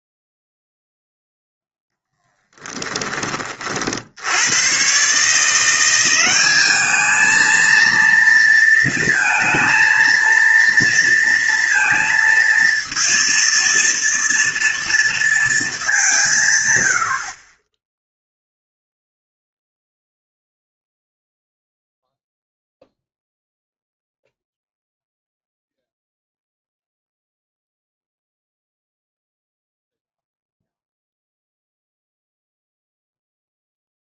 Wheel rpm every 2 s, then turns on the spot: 0, 10, 110, 200, 230, 230, 230, 230, 130, 0, 0, 0, 0, 0, 0, 0, 0.
none